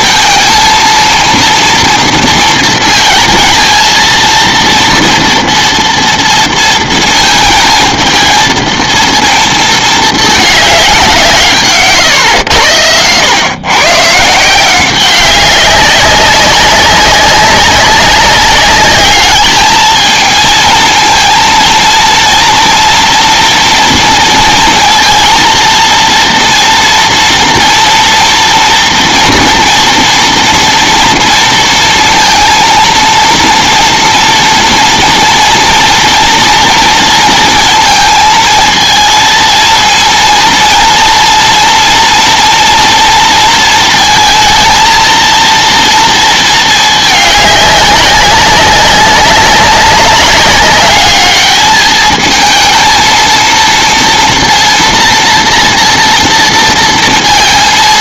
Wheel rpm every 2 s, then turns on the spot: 230, 230, 230, 230, 220, 200, 90, 180, 190, 200, 230, 230, 230, 230, 230, 240, 230, 230, 230, 230, 230, 230, 230, 220, 200, 200, 230, 230, 230.
none